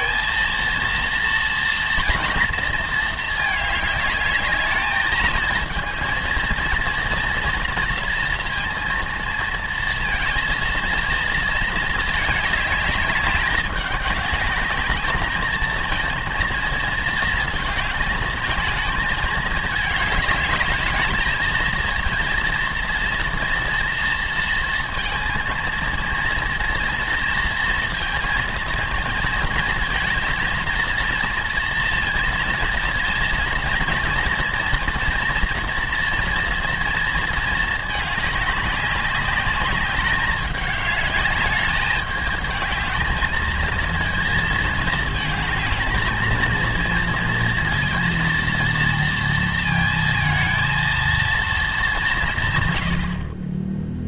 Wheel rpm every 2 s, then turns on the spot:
230, 220, 220, 230, 230, 220, 200, 210, 220, 210, 220, 240, 230, 230, 230, 230, 230, 230, 230, 200, 210, 220, 220, 230, 230, 230, 60.
none